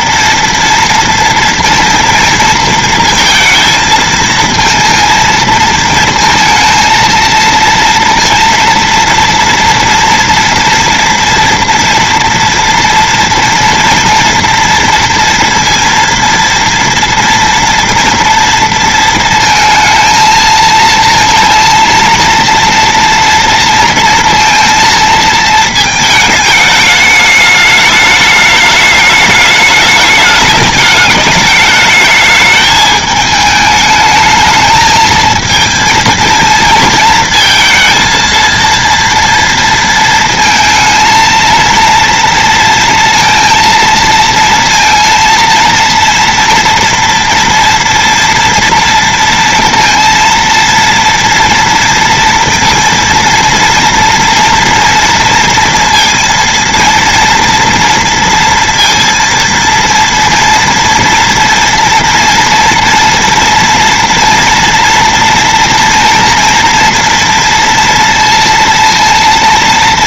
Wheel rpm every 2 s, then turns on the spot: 230, 230, 230, 230, 230, 230, 230, 230, 230, 230, 230, 240, 220, 210, 210, 210, 210, 220, 230, 230, 230, 230, 230, 240, 230, 240, 230, 230, 230, 230, 230, 230, 230, 230, 230.
none